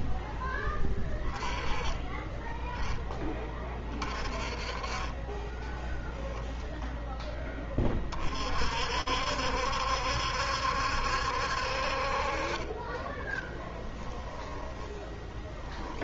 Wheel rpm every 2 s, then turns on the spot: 10, 10, 30, 0, 60, 70, 20, 10.
12-16